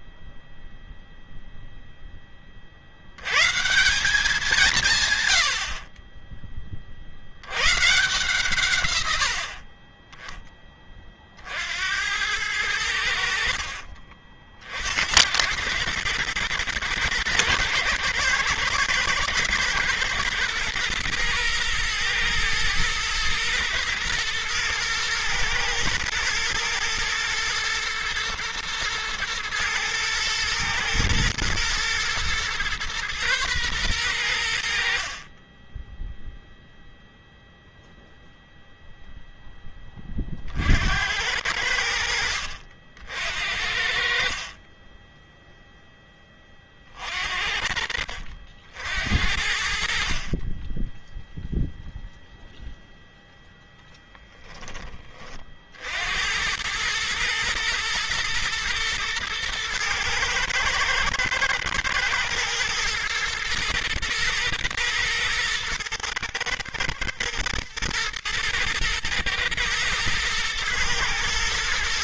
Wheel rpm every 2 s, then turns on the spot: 0, 80, 150, 50, 120, 30, 80, 70, 120, 120, 120, 120, 120, 120, 110, 110, 120, 70, 0, 0, 70, 70, 30, 40, 70, 10, 0, 20, 110, 110, 110, 110, 110, 120, 110, 120.
34-36 44-48